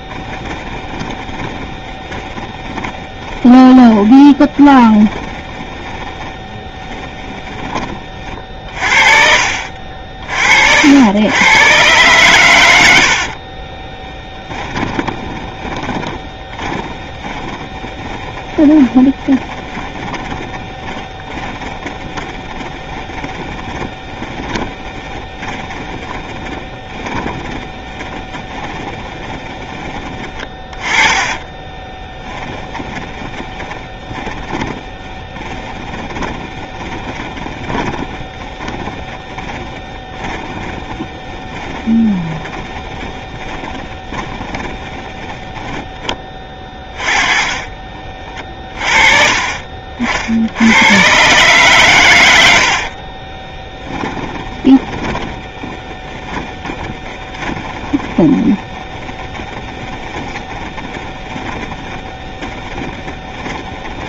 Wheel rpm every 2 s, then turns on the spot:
20, 20, 20, 20, 40, 50, 110, 10, 10, 20, 10, 20, 20, 30, 20, 20, 20, 30, 20, 30, 20, 20, 20, 20, 40, 80, 80, 10, 20, 20, 20, 20.
0-8 14-48 52-64